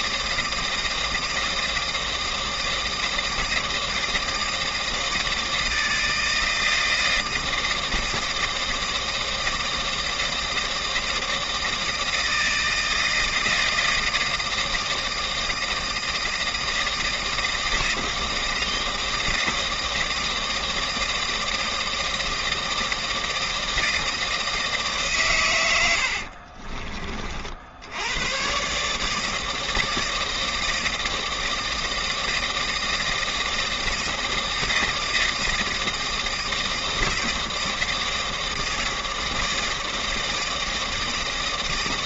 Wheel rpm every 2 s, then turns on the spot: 160, 160, 160, 160, 160, 160, 160, 160, 160, 160, 160, 160, 160, 40, 140, 160, 160, 160, 160, 160, 160.
26-28